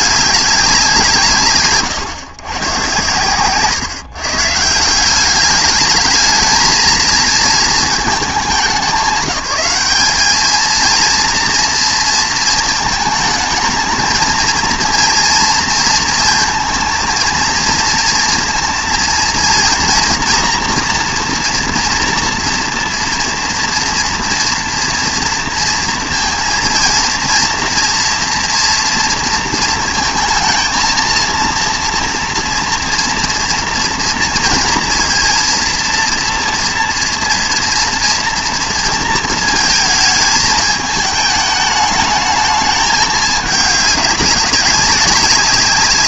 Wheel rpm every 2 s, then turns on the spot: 190, 120, 170, 220, 190, 230, 220, 230, 230, 230, 240, 230, 230, 230, 230, 230, 230, 230, 230, 230, 210, 210, 190.
none